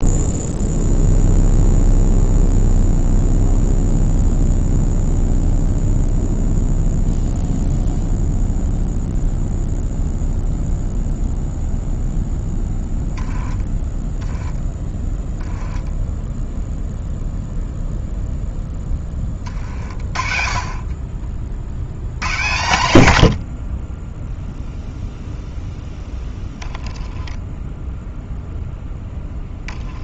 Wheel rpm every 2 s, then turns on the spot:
0, 0, 0, 0, 0, 0, 10, 10, 0, 10, 40, 100, 0, 0, 0.
none